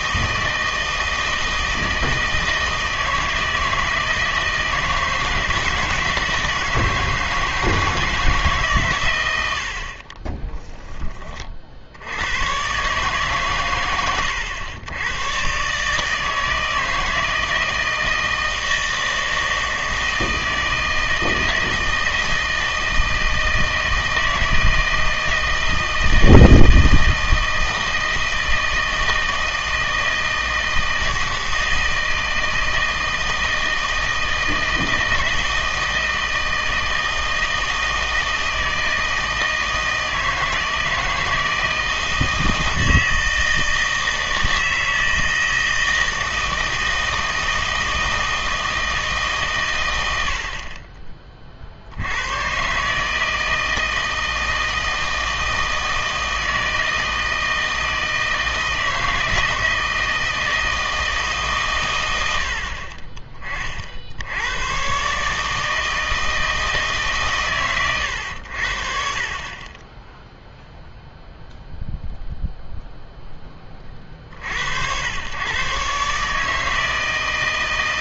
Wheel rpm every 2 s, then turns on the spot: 160, 160, 160, 160, 140, 10, 140, 100, 160, 160, 160, 160, 160, 160, 160, 160, 160, 160, 160, 160, 160, 160, 160, 160, 160, 40, 130, 160, 160, 160, 160, 40, 110, 160, 60, 0, 0, 70, 160.
none